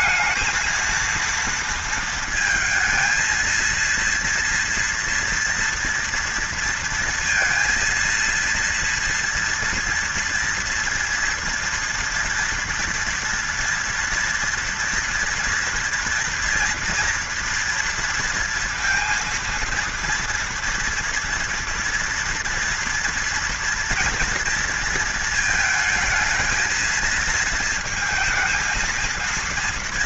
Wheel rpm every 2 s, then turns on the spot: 230, 230, 240, 230, 230, 230, 230, 230, 230, 230, 230, 240, 230, 220, 230.
none